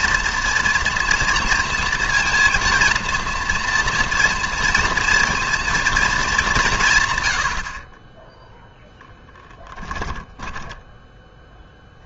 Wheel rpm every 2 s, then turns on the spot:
230, 230, 230, 170, 0, 10.
10-12